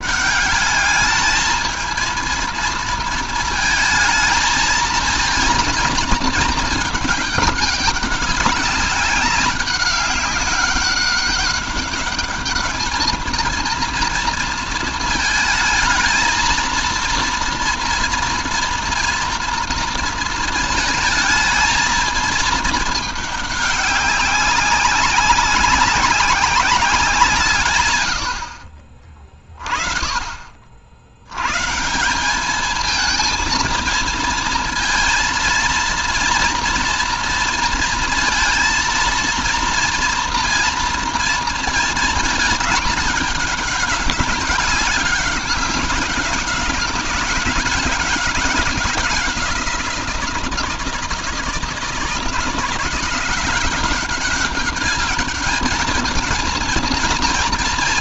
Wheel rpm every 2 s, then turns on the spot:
210, 230, 230, 210, 190, 200, 220, 220, 230, 230, 220, 210, 190, 180, 30, 80, 220, 230, 230, 230, 230, 210, 200, 190, 190, 170, 170, 200, 230.
none